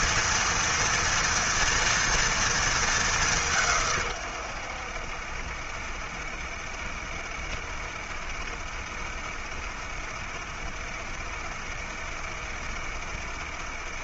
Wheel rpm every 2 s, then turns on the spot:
230, 230, 100, 70, 70, 70, 70.
none